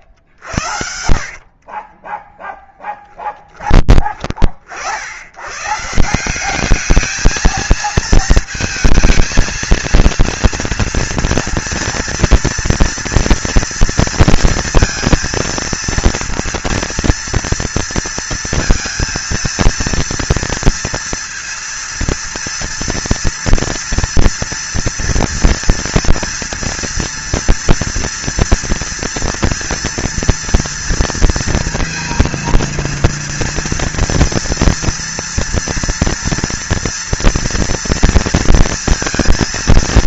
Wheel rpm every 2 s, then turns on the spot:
70, 10, 50, 190, 220, 230, 230, 230, 230, 230, 230, 230, 240, 230, 230, 230, 230, 230, 230, 230.
0-2